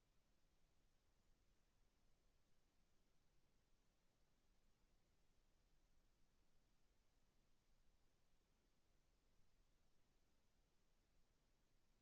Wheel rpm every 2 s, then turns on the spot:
0, 0, 0, 0, 0, 0.
none